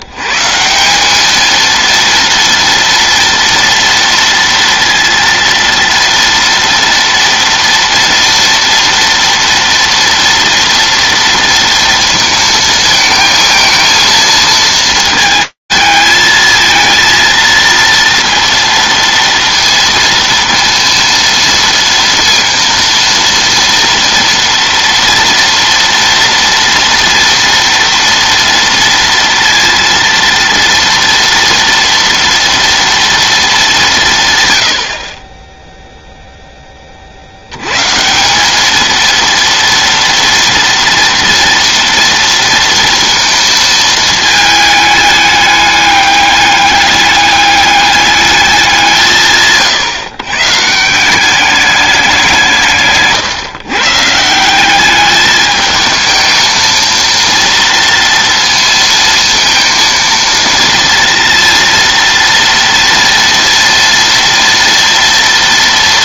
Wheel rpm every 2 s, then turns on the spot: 60, 230, 230, 230, 230, 230, 230, 230, 220, 230, 230, 230, 230, 230, 230, 230, 230, 120, 20, 210, 230, 230, 220, 200, 190, 160, 160, 190, 230, 230, 230, 230, 230.
none